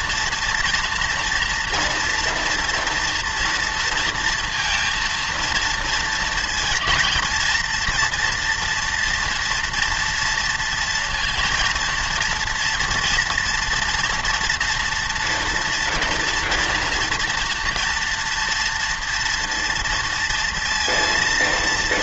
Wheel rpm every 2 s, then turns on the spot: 230, 240, 230, 230, 240, 230, 230, 230, 230, 230, 230.
none